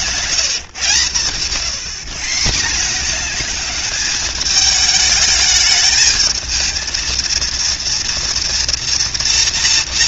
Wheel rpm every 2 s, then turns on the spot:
130, 200, 210, 230, 240.
none